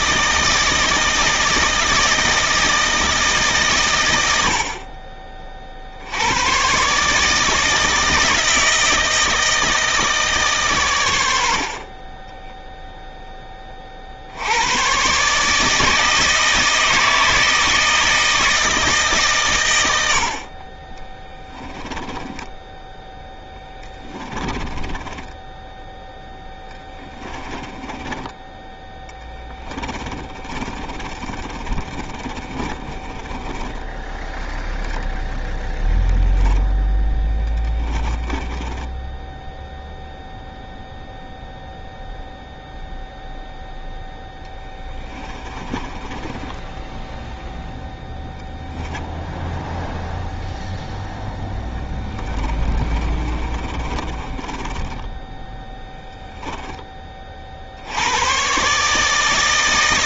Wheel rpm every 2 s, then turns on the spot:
160, 160, 50, 140, 160, 130, 0, 100, 160, 160, 30, 10, 20, 10, 20, 40, 30, 0, 10, 20, 0, 0, 10, 10, 0, 0, 20, 20, 20, 140.
24-28 30-34 36-40 44-48 52-56